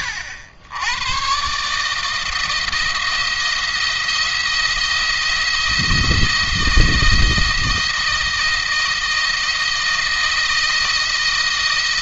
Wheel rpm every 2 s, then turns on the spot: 100, 160, 170, 170, 160, 170.
none